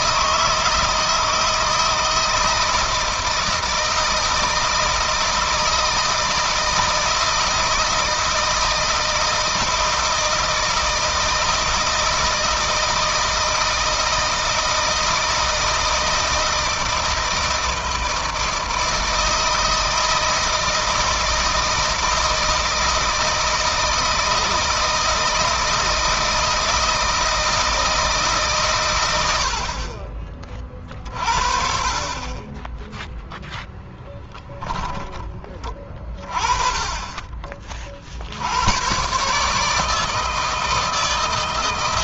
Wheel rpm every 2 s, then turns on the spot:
160, 160, 160, 160, 160, 160, 160, 160, 160, 160, 160, 160, 160, 160, 110, 30, 10, 10, 20, 110, 160.
none